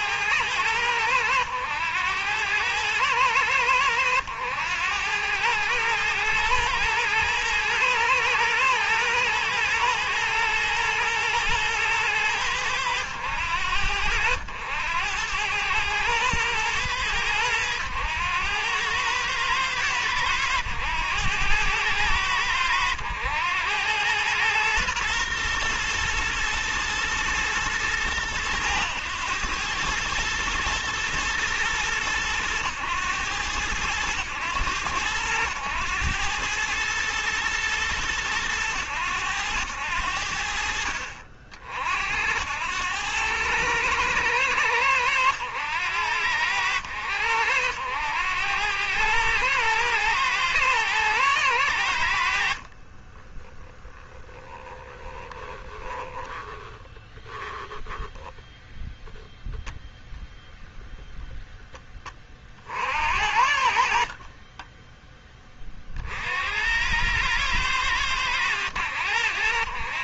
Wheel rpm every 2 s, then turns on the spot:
100, 100, 90, 110, 120, 120, 100, 90, 110, 100, 100, 100, 120, 120, 100, 110, 100, 90, 110, 100, 70, 90, 100, 80, 100, 110, 50, 20, 20, 0, 0, 50, 20, 80, 90.
52-58